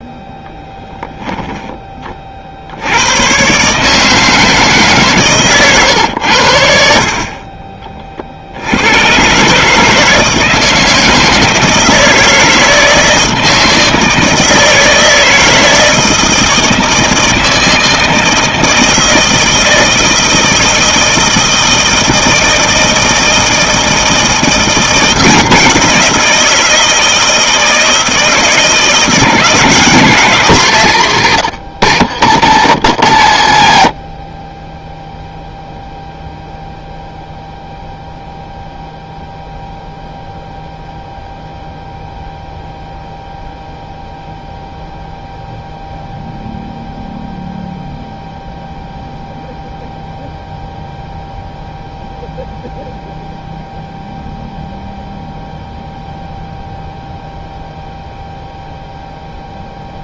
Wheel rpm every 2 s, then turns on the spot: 10, 70, 150, 70, 70, 160, 160, 160, 160, 160, 160, 160, 170, 170, 160, 170, 90, 20, 0, 0, 0, 0, 0, 0, 0, 0, 0, 0, 0, 0.
none